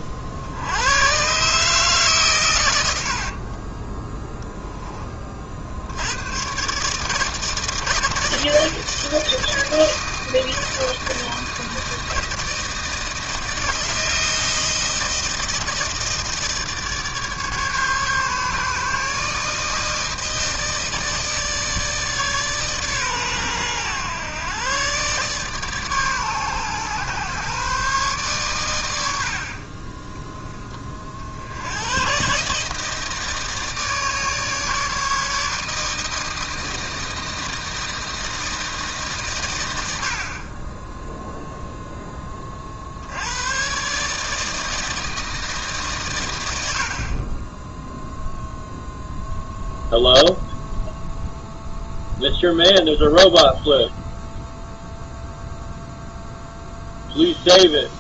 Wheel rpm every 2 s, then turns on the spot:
60, 90, 10, 130, 160, 160, 160, 160, 160, 150, 160, 140, 130, 130, 110, 10, 150, 150, 160, 160, 20, 50, 160, 90, 0, 0, 0, 0, 0.
none